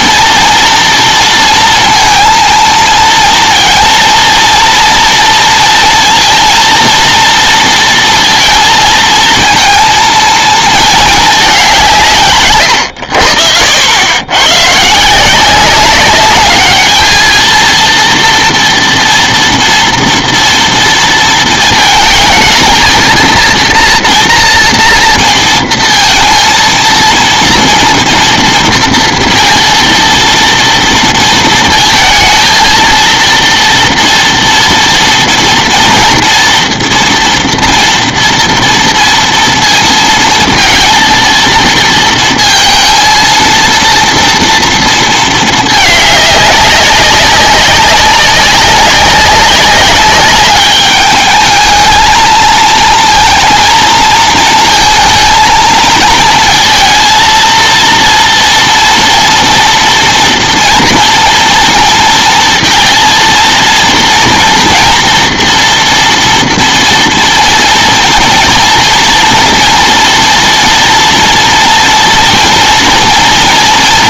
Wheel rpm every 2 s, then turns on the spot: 230, 230, 230, 230, 230, 220, 120, 120, 210, 230, 230, 220, 230, 230, 230, 230, 230, 230, 230, 230, 230, 230, 230, 200, 200, 200, 220, 220, 230, 230, 230, 230, 240, 230, 240, 230, 230.
none